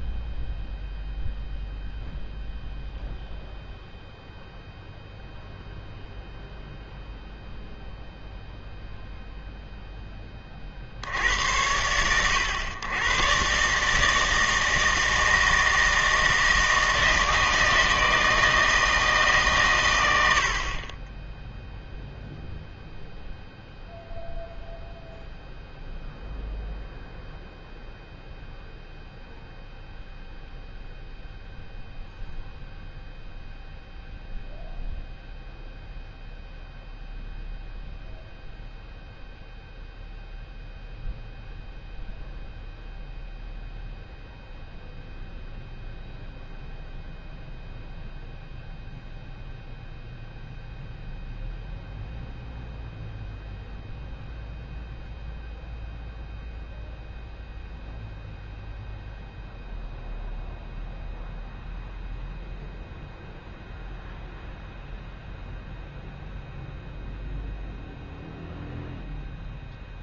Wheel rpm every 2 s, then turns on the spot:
0, 0, 0, 0, 0, 10, 100, 160, 160, 160, 50, 0, 0, 0, 0, 0, 0, 0, 0, 0, 0, 0, 0, 0, 0, 0, 0, 0, 0, 0, 0, 0, 0, 0, 0.
none